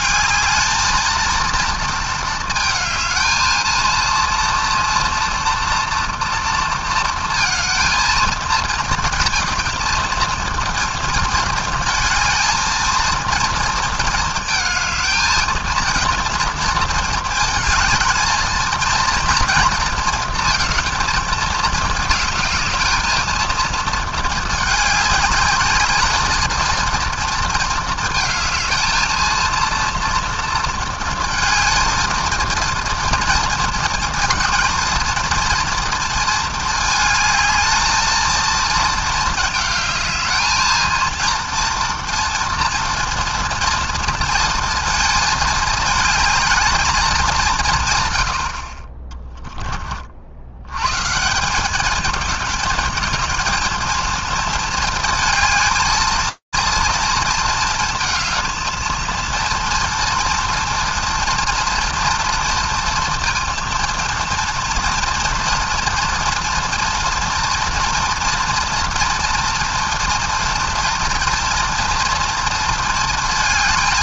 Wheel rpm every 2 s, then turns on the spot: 220, 220, 230, 230, 230, 230, 230, 230, 230, 220, 220, 220, 210, 220, 220, 230, 230, 220, 220, 220, 220, 240, 230, 220, 70, 80, 220, 220, 230, 220, 230, 230, 240, 230, 230, 240, 230.
none